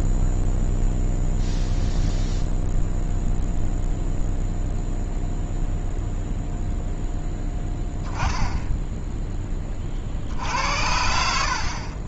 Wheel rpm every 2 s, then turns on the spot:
0, 0, 0, 0, 10, 70.
none